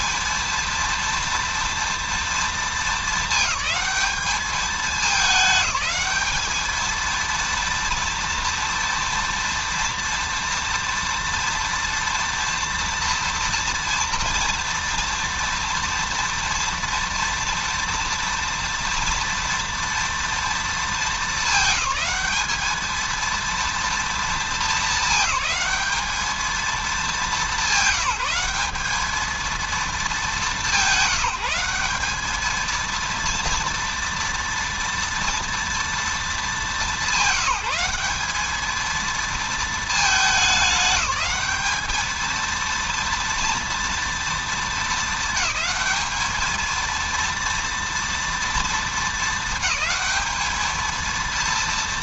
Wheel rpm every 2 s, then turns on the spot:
230, 220, 210, 220, 230, 230, 240, 240, 240, 230, 230, 220, 220, 210, 200, 190, 220, 230, 210, 210, 210, 230, 220, 220, 230, 220.
none